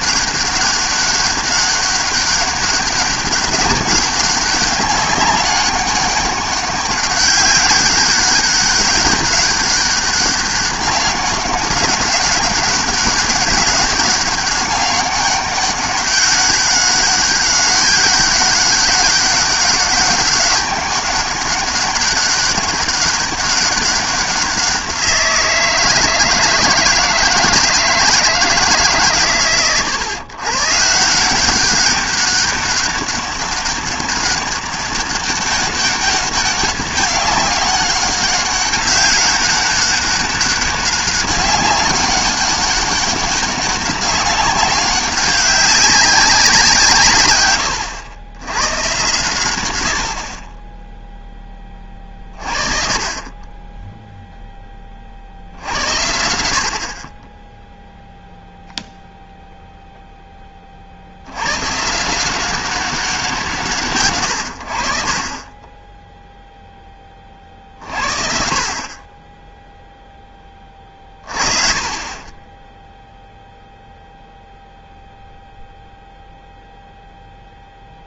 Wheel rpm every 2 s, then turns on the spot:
200, 200, 190, 200, 200, 200, 200, 200, 200, 200, 200, 200, 180, 160, 130, 160, 200, 200, 200, 200, 200, 200, 190, 160, 120, 10, 40, 20, 60, 0, 40, 190, 50, 10, 40, 30, 0, 0, 0.
none